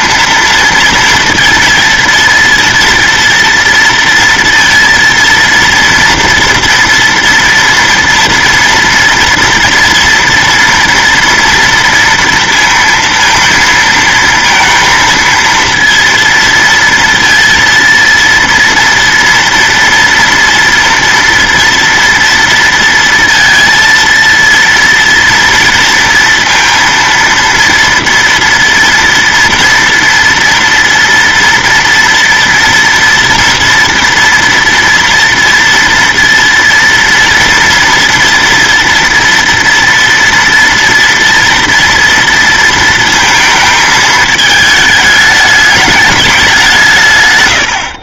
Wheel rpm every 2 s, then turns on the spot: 230, 230, 230, 230, 230, 230, 230, 230, 230, 230, 230, 230, 230, 230, 230, 230, 230, 230, 230, 240, 230, 230, 210, 170.
none